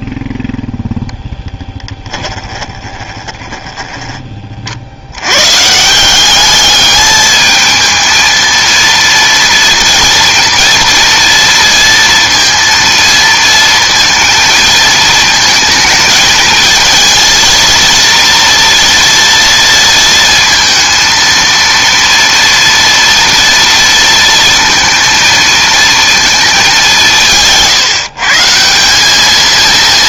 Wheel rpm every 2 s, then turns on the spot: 0, 20, 50, 210, 230, 230, 230, 220, 220, 230, 230, 230, 230, 200, 180.
2-4